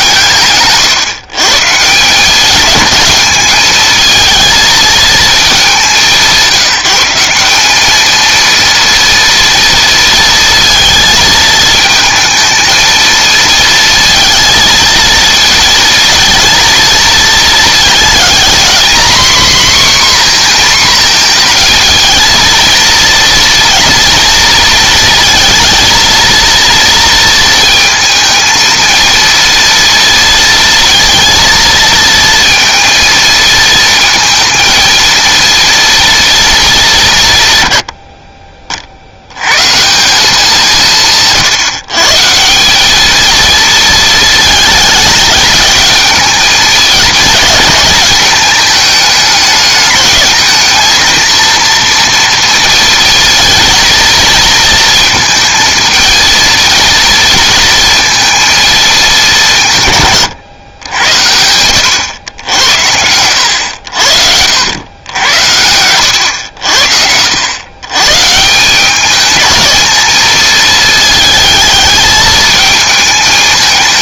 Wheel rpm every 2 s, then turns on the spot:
140, 210, 230, 180, 230, 230, 220, 230, 230, 250, 250, 230, 230, 230, 230, 230, 230, 230, 200, 40, 170, 190, 220, 210, 210, 220, 230, 230, 230, 220, 100, 90, 80, 80, 180, 220, 220.
none